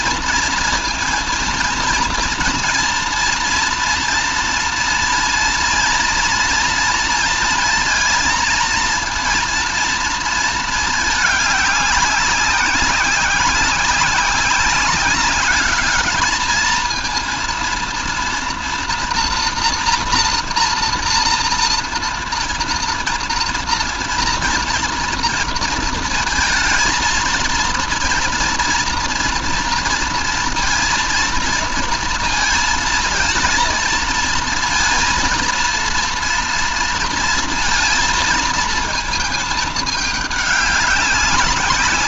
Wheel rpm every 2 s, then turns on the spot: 230, 230, 230, 230, 230, 220, 190, 190, 220, 230, 230, 230, 230, 230, 230, 230, 230, 230, 230, 230, 210.
none